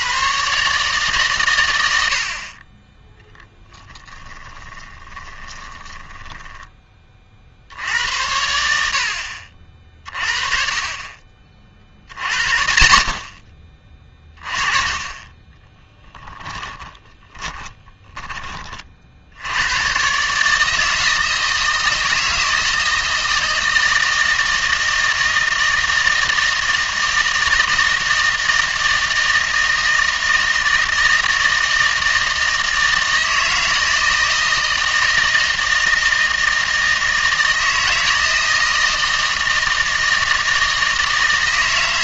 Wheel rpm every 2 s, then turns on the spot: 140, 30, 20, 10, 80, 40, 50, 20, 20, 30, 160, 160, 160, 160, 160, 160, 160, 160, 160, 160, 160.
4-6 16-18